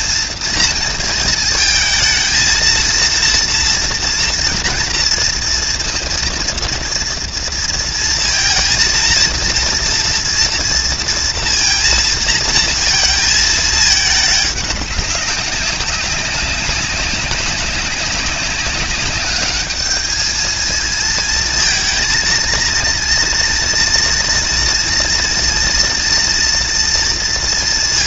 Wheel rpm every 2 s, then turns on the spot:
230, 220, 230, 230, 230, 230, 230, 200, 200, 200, 220, 230, 240, 230.
none